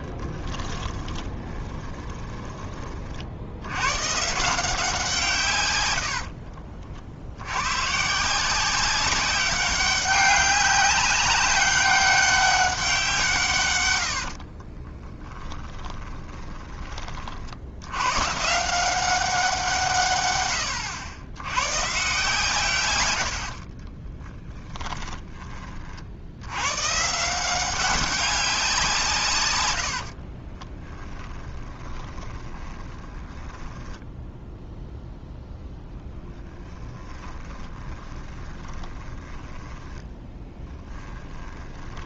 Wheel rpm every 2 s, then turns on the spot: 20, 30, 170, 50, 190, 200, 190, 20, 20, 170, 100, 120, 10, 120, 170, 10, 20, 0, 10, 20, 20.
0-2 14-16 24-26 30-34 36-42